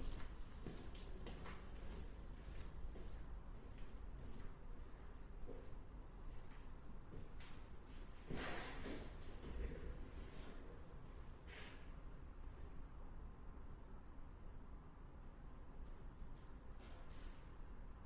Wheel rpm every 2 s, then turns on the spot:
0, 0, 0, 0, 0, 0, 0, 0, 0.
none